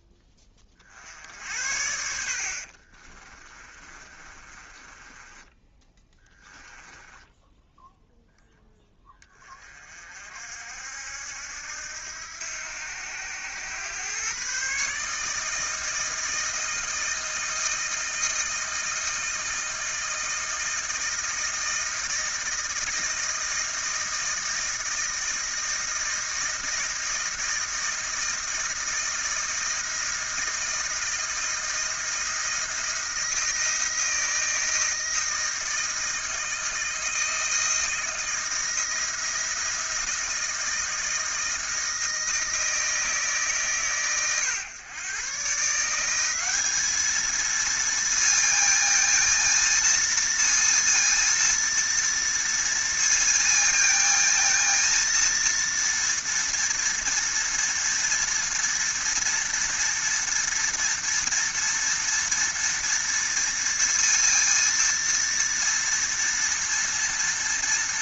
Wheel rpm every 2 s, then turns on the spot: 50, 30, 20, 10, 10, 70, 90, 150, 160, 160, 160, 160, 160, 160, 160, 160, 170, 160, 160, 170, 160, 160, 120, 220, 230, 230, 230, 230, 230, 230, 230, 230, 230, 230.
2-8